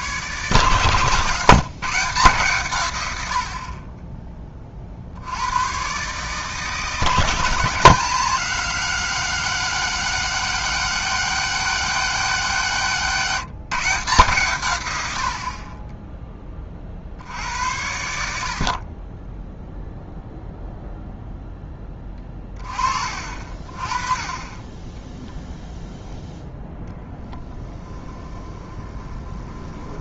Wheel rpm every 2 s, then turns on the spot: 140, 140, 30, 150, 180, 200, 180, 140, 20, 60, 0, 20, 20, 0, 20.
28-30